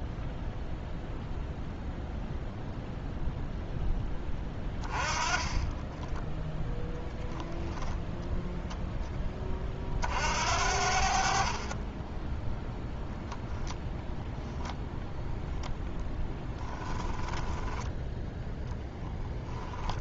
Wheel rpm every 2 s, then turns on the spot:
0, 0, 20, 0, 10, 60, 0, 0, 10, 0.
4-6 16-18